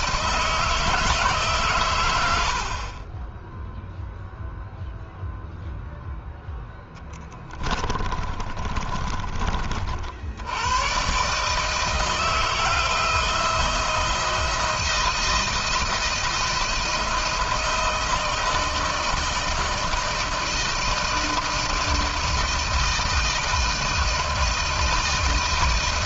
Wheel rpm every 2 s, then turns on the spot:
170, 50, 0, 10, 30, 100, 160, 170, 160, 160, 160, 160, 160.
6-10